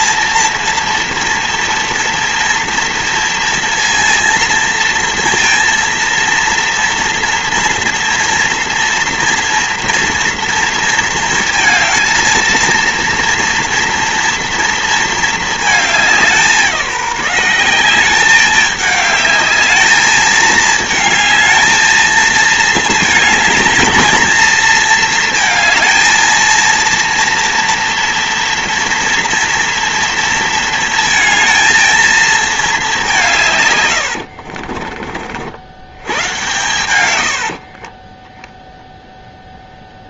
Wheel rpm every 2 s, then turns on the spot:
230, 230, 230, 230, 230, 230, 230, 230, 200, 200, 210, 220, 220, 230, 230, 230, 220, 80, 110, 20.
34-36